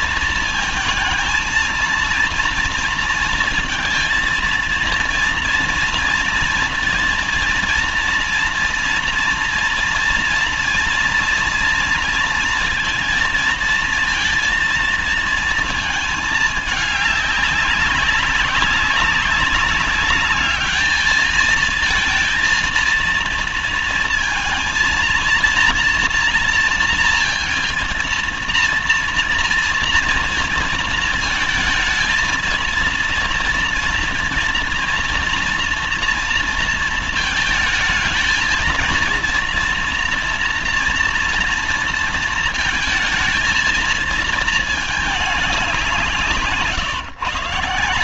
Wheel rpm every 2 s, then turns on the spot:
230, 230, 230, 230, 230, 230, 230, 230, 210, 190, 210, 230, 230, 230, 230, 230, 230, 230, 230, 230, 240, 230, 220, 140.
none